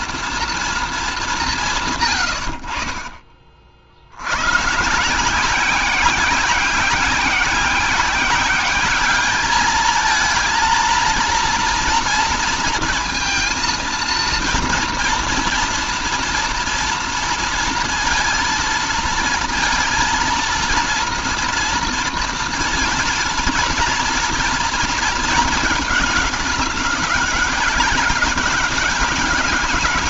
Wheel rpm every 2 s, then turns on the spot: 220, 60, 130, 180, 200, 230, 230, 230, 230, 230, 230, 230, 230, 200, 190.
none